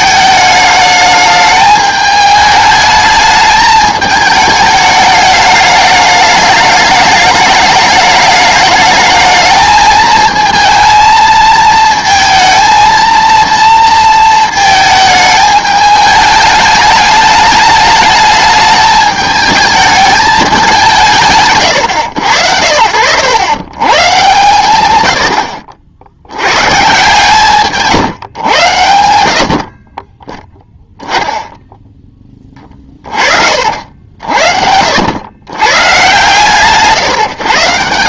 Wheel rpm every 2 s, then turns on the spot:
210, 210, 210, 210, 210, 220, 230, 220, 210, 210, 190, 80, 120, 130, 110, 10, 40, 70, 150.
32-34